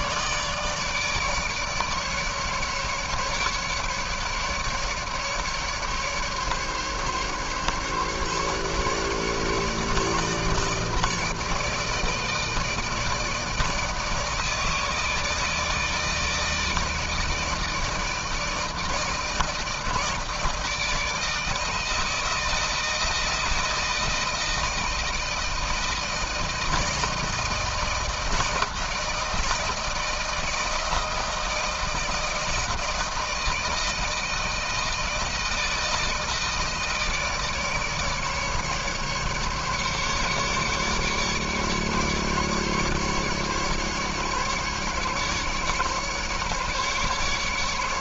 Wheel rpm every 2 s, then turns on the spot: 160, 150, 150, 140, 150, 150, 160, 160, 160, 160, 160, 160, 160, 160, 160, 160, 160, 160, 160, 150, 140, 140, 150, 150.
none